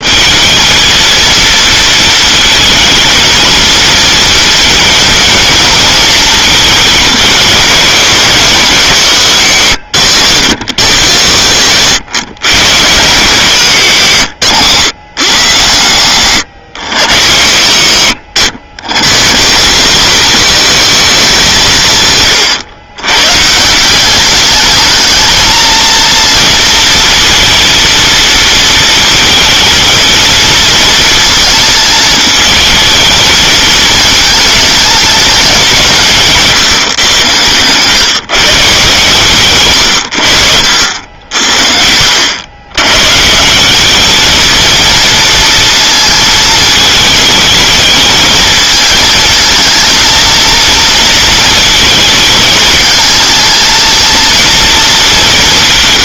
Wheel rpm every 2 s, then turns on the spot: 220, 220, 230, 210, 170, 130, 130, 130, 110, 120, 210, 120, 220, 230, 220, 230, 220, 220, 130, 150, 70, 120, 230, 220, 220, 230, 220, 220.
40-42